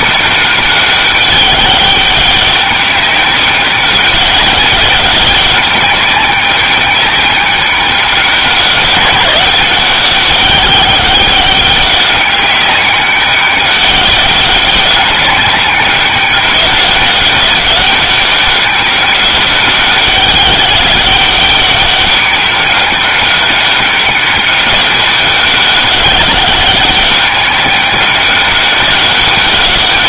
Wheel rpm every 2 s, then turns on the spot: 200, 200, 190, 200, 180, 200, 190, 190, 200, 200, 200, 200, 200, 190, 200.
none